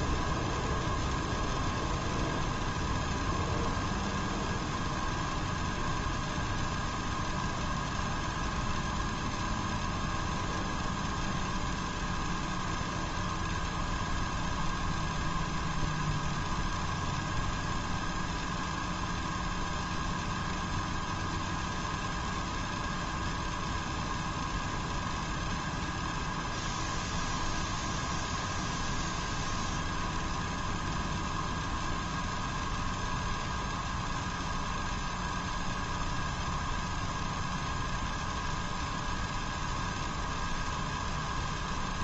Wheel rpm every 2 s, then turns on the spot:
0, 0, 0, 0, 0, 0, 0, 0, 0, 0, 0, 0, 0, 0, 0, 0, 0, 0, 0, 0, 0.
none